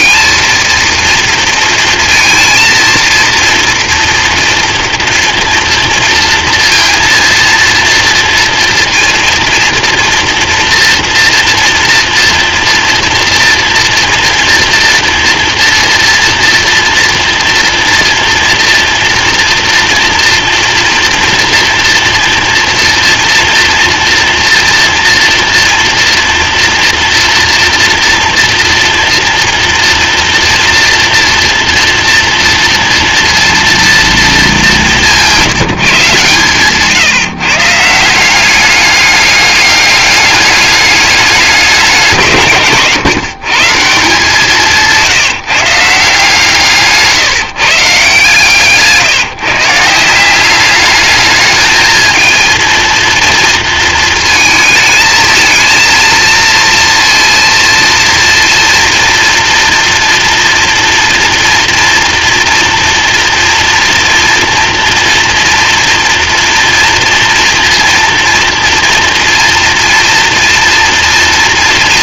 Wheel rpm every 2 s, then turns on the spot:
230, 230, 230, 230, 230, 230, 230, 230, 240, 230, 230, 230, 230, 230, 230, 240, 230, 210, 150, 190, 210, 160, 170, 150, 150, 190, 230, 220, 230, 230, 240, 230, 230, 240, 230, 230.
none